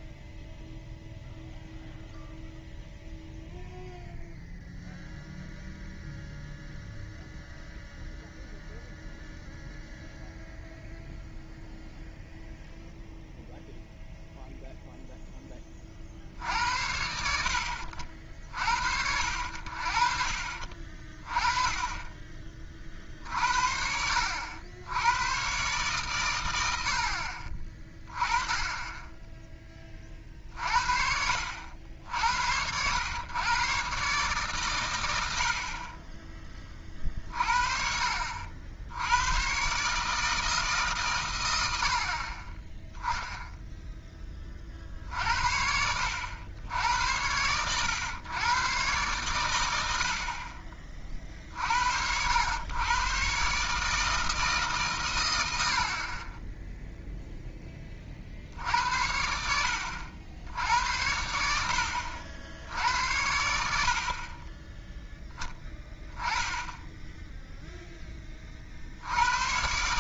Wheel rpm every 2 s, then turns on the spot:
0, 0, 0, 0, 0, 0, 0, 0, 70, 60, 40, 40, 90, 90, 20, 50, 80, 130, 40, 70, 150, 20, 40, 90, 120, 40, 110, 150, 10, 70, 80, 80, 20, 10, 50.
none